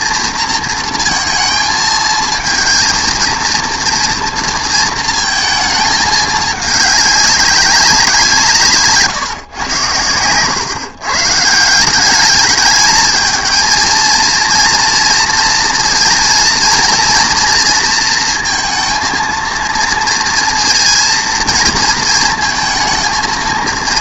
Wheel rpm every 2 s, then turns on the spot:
230, 220, 230, 210, 160, 120, 200, 230, 230, 230, 230, 220.
none